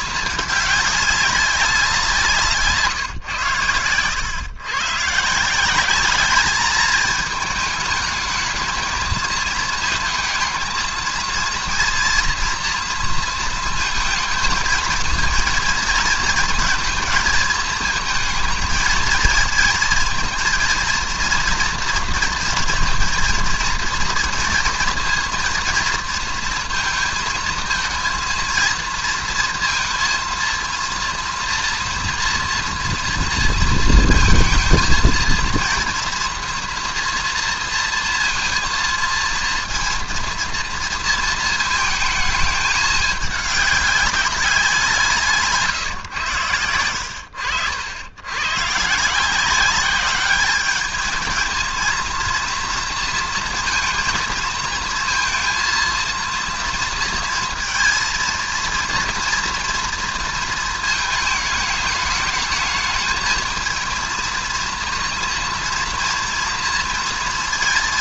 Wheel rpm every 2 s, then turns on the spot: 210, 150, 130, 220, 220, 230, 230, 220, 230, 220, 230, 230, 230, 230, 230, 230, 230, 230, 230, 230, 230, 220, 190, 100, 130, 210, 230, 230, 230, 230, 220, 220, 230, 230.
none